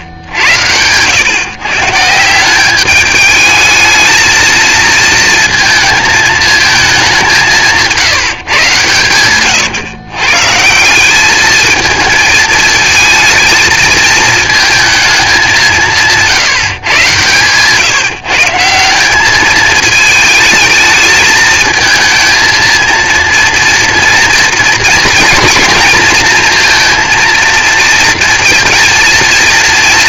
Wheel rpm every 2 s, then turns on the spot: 100, 200, 220, 220, 140, 160, 220, 220, 140, 170, 220, 230, 230, 230, 230.
none